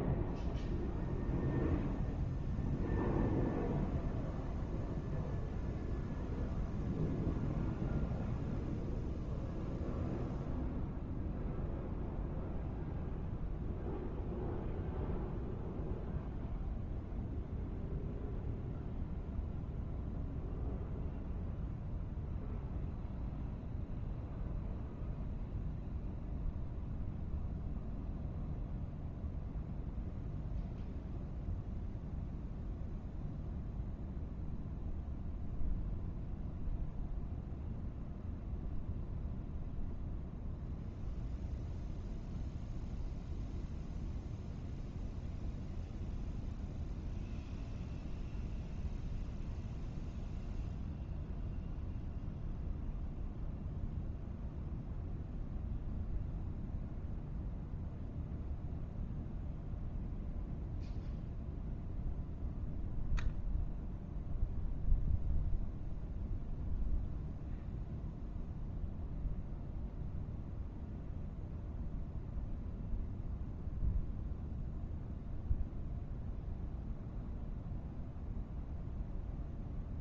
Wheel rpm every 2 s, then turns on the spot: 0, 0, 0, 0, 0, 0, 0, 0, 0, 0, 0, 0, 0, 0, 0, 0, 0, 0, 0, 0, 0, 0, 0, 0, 0, 0, 0, 0, 0, 0, 0, 0, 0, 0, 0, 0, 0, 0, 0, 0.
none